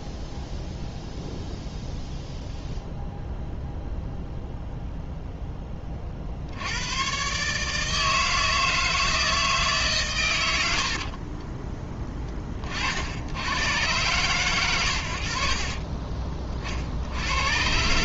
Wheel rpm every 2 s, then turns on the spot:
0, 0, 0, 90, 160, 70, 40, 110, 50.
10-12